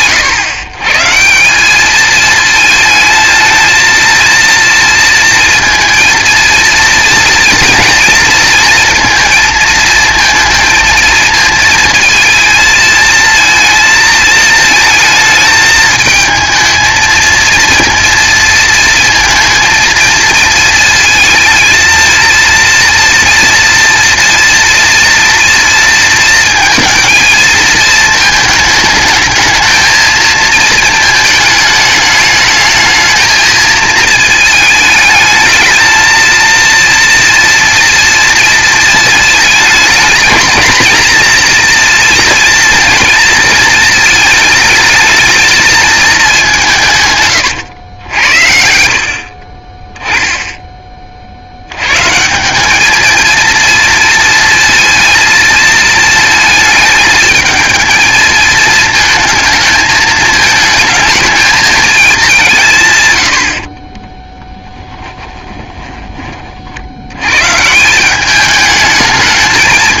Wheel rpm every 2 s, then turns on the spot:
130, 220, 230, 230, 230, 230, 220, 220, 220, 230, 220, 230, 240, 230, 220, 220, 220, 210, 230, 220, 230, 230, 220, 170, 60, 20, 210, 230, 220, 220, 220, 130, 10, 90, 210.
64-66